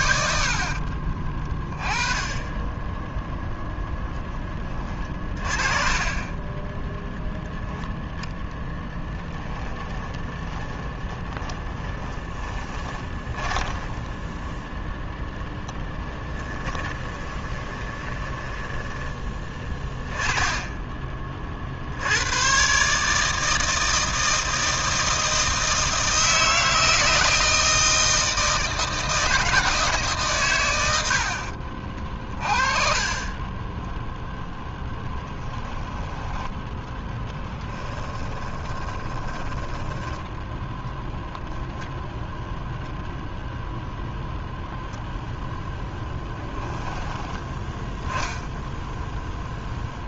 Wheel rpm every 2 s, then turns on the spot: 40, 10, 30, 10, 10, 20, 20, 0, 20, 20, 10, 130, 160, 160, 160, 90, 40, 10, 10, 20, 10, 0, 0, 10, 0.
2-4 8-14 16-20 38-40